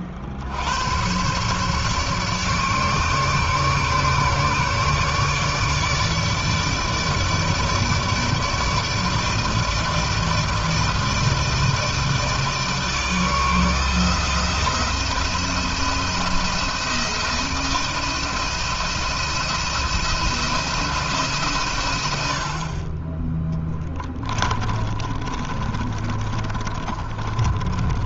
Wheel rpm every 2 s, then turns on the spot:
80, 150, 150, 150, 150, 160, 160, 170, 170, 160, 170, 50, 20, 30.
24-28